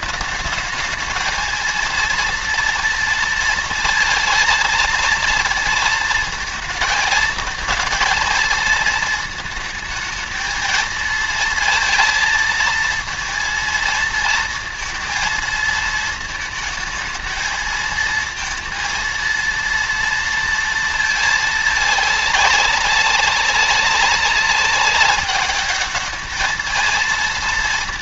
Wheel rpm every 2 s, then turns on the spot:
220, 230, 230, 220, 230, 220, 220, 220, 220, 230, 230, 200, 200, 220.
none